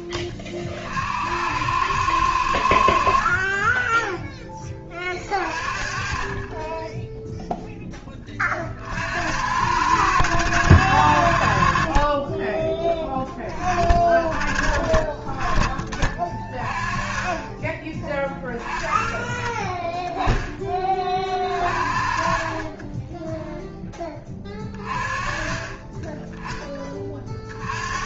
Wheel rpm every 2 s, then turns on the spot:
40, 80, 20, 20, 50, 70, 10, 30, 30, 20, 20, 40, 30, 10.
22-24